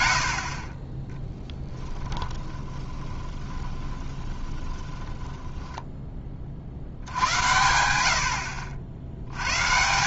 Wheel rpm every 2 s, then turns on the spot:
10, 20, 10, 60, 80.
0-6